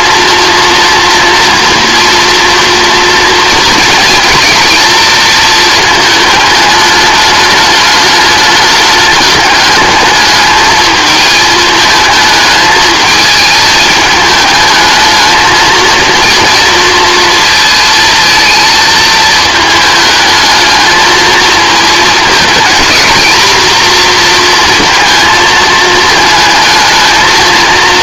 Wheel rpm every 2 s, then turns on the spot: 230, 230, 230, 210, 210, 220, 220, 220, 230, 220, 220, 230, 230, 220.
none